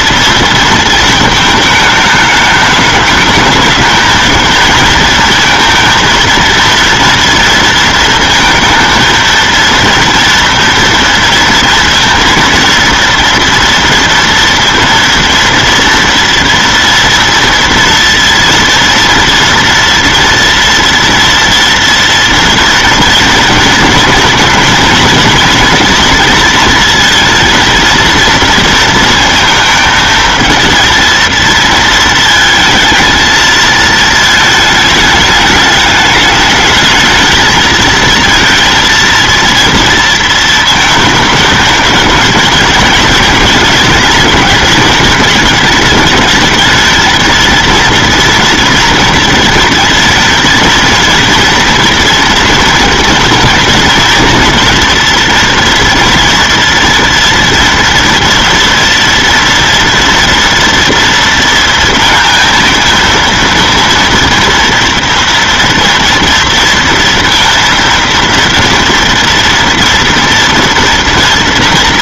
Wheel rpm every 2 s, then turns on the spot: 220, 210, 220, 230, 220, 230, 230, 230, 230, 230, 230, 230, 230, 230, 220, 230, 220, 220, 220, 230, 220, 210, 210, 220, 230, 230, 230, 230, 230, 230, 230, 230, 230, 230, 230, 230.
none